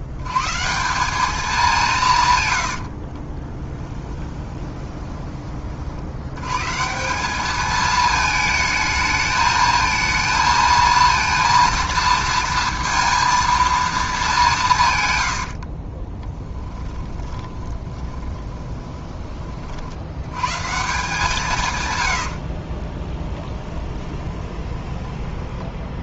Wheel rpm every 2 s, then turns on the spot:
170, 60, 20, 140, 220, 230, 230, 150, 20, 20, 150, 30, 10.
2-6 16-20 22-26